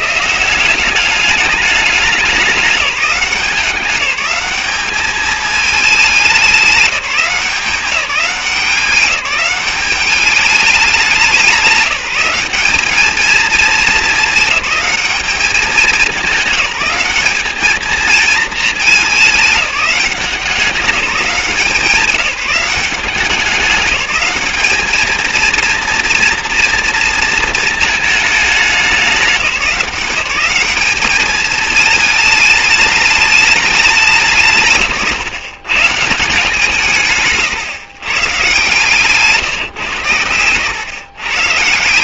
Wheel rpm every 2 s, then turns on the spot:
170, 200, 200, 190, 190, 200, 200, 210, 200, 210, 180, 190, 210, 230, 210, 200, 210, 140, 170, 150, 110.
none